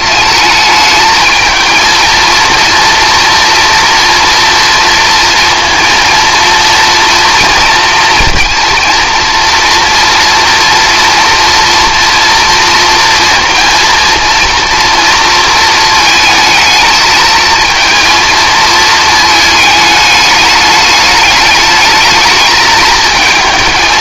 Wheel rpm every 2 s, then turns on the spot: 210, 230, 230, 230, 230, 230, 230, 230, 220, 220, 210, 210.
none